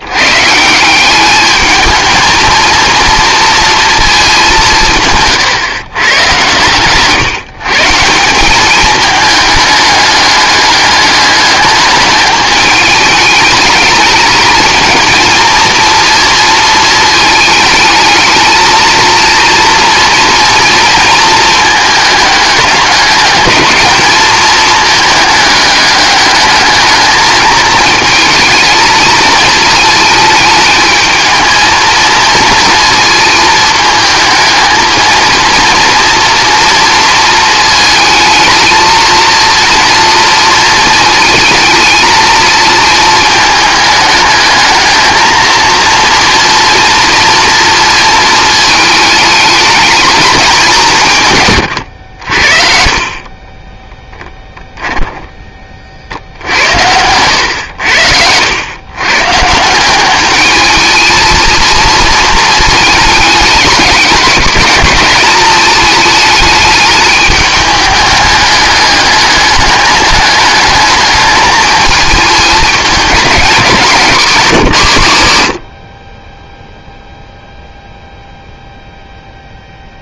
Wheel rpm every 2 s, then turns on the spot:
180, 230, 170, 140, 210, 210, 210, 220, 220, 230, 230, 200, 220, 210, 220, 220, 230, 220, 230, 230, 220, 230, 220, 240, 220, 170, 40, 10, 80, 120, 220, 220, 200, 210, 210, 210, 210, 140, 0, 0.
54-56